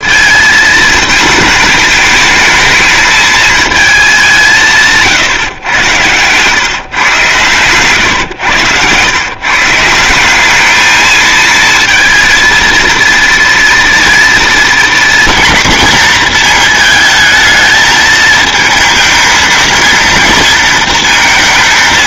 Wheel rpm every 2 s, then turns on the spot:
220, 220, 160, 130, 100, 200, 220, 230, 230, 220, 230.
none